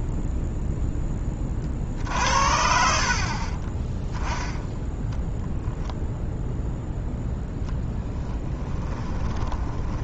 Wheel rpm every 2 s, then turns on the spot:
0, 60, 10, 0, 20.
4-6 8-10